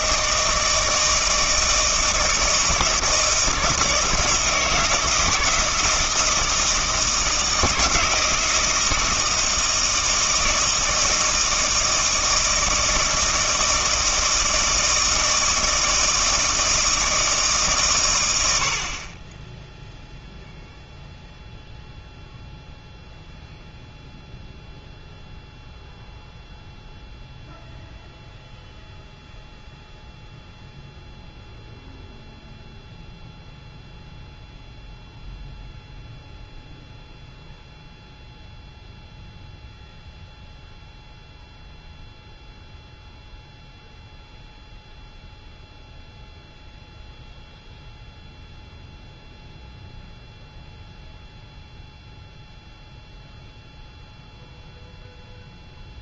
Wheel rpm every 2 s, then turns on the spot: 160, 160, 160, 160, 160, 160, 160, 160, 160, 60, 0, 0, 0, 0, 0, 0, 0, 0, 0, 0, 0, 0, 0, 0, 0, 0, 0, 0.
none